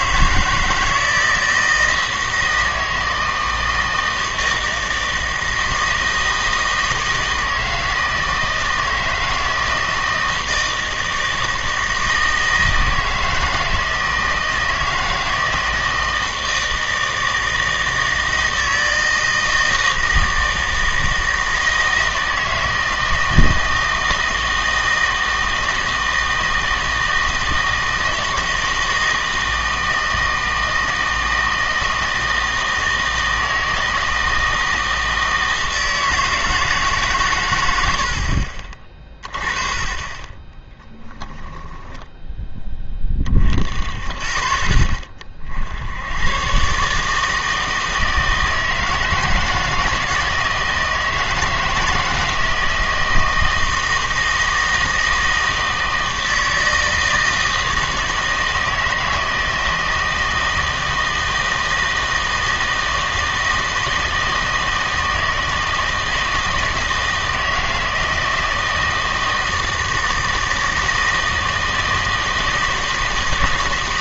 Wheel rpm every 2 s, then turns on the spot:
160, 160, 160, 160, 160, 160, 160, 160, 160, 160, 160, 160, 160, 160, 160, 160, 160, 160, 160, 40, 20, 20, 20, 130, 160, 160, 160, 160, 160, 160, 160, 160, 160, 160, 160, 160, 160.
40-42